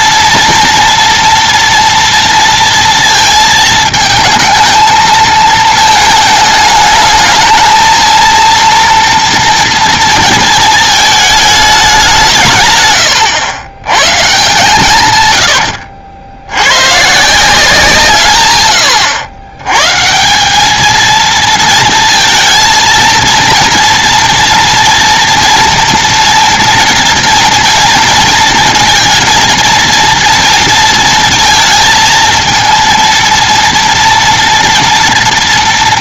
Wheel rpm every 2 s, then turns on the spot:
240, 230, 220, 220, 230, 220, 120, 120, 120, 100, 220, 230, 230, 230, 220, 220, 230, 230.
14-16